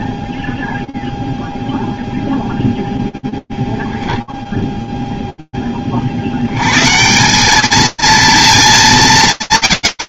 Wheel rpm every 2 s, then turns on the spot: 0, 0, 0, 30, 220.
none